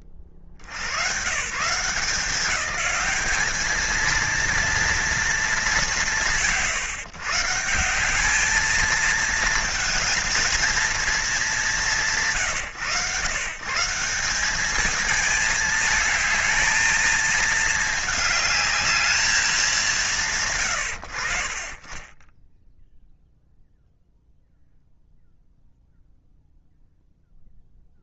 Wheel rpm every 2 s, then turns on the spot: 60, 200, 230, 130, 220, 220, 120, 200, 220, 210, 70, 0, 0, 0.
none